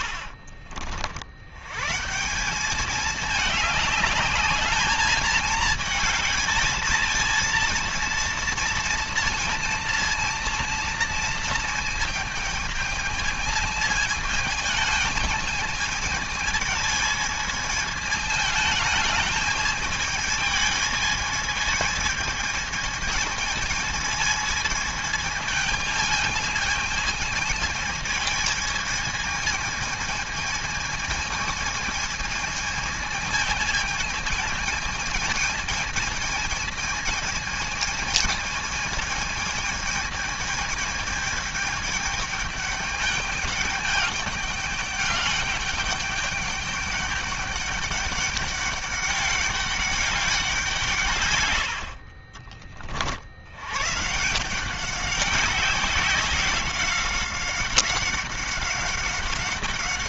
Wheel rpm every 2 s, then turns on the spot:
50, 180, 210, 220, 230, 230, 220, 220, 220, 220, 220, 220, 220, 220, 220, 220, 220, 220, 220, 220, 210, 210, 200, 200, 200, 180, 50, 170, 190, 190.
0-2 52-54